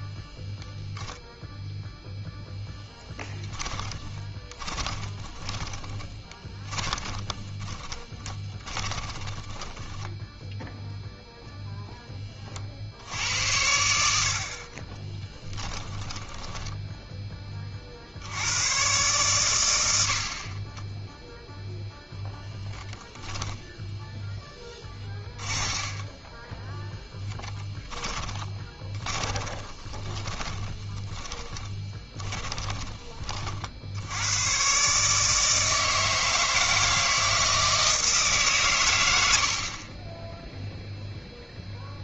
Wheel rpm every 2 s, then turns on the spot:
0, 10, 20, 20, 20, 0, 60, 30, 10, 110, 20, 10, 20, 10, 20, 20, 20, 130, 160, 110, 0.
4-10 14-16 22-34